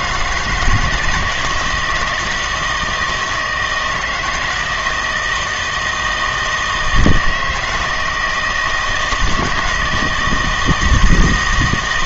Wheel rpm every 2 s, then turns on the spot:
170, 160, 160, 160, 160, 160.
none